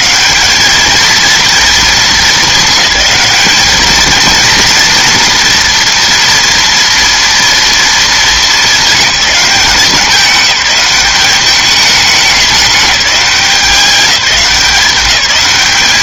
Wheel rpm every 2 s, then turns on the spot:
210, 220, 230, 230, 220, 200, 200, 190.
none